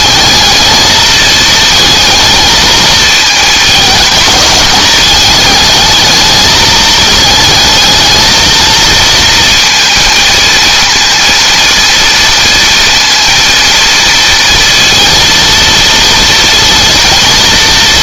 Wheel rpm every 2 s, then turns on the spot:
220, 220, 210, 220, 230, 230, 230, 230, 230.
none